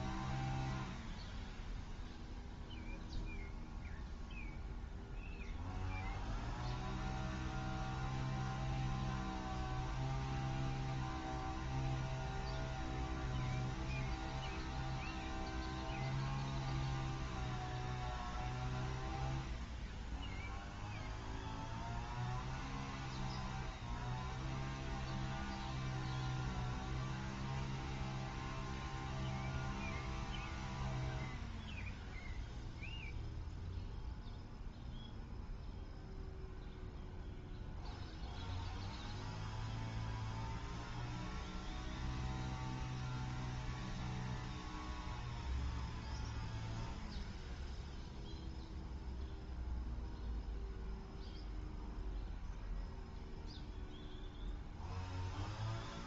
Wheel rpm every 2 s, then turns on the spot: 0, 0, 0, 0, 0, 0, 0, 0, 0, 0, 0, 0, 0, 0, 0, 0, 0, 0, 0, 0, 0, 0, 0, 0, 0, 0, 0, 0.
none